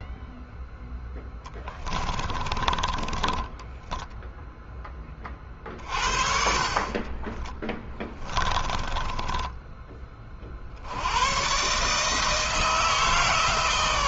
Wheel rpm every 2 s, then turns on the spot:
0, 20, 10, 40, 20, 50, 160.
2-4 8-10